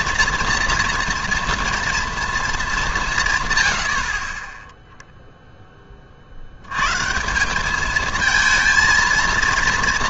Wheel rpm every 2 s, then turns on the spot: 230, 210, 10, 90, 230.
none